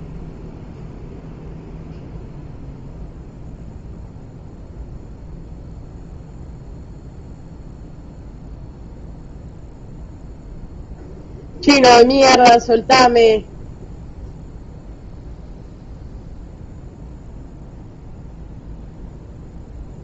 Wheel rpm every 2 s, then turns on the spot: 0, 0, 0, 0, 0, 0, 0, 0, 0, 0.
none